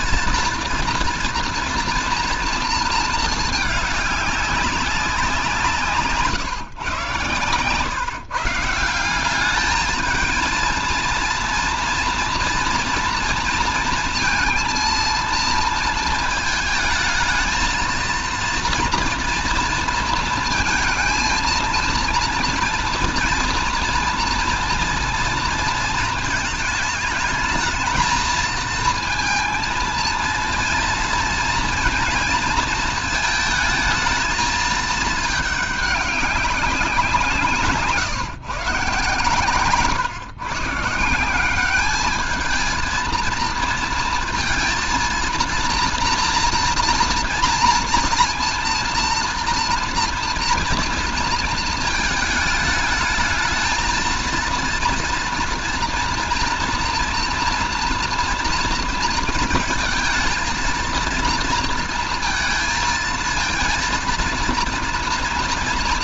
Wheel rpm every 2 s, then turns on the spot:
230, 230, 190, 140, 170, 220, 230, 230, 220, 230, 230, 230, 230, 220, 230, 230, 230, 220, 180, 140, 150, 220, 230, 230, 230, 230, 220, 230, 230, 230, 230, 220, 230.
none